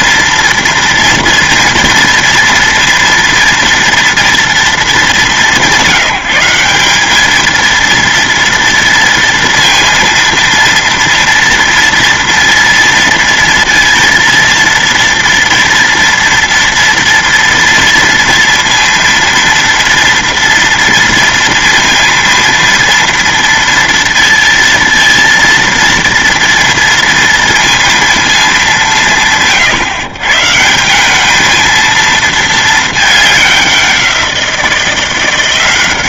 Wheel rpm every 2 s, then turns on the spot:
230, 230, 220, 190, 230, 230, 230, 230, 230, 230, 230, 230, 230, 230, 190, 160, 210, 170.
none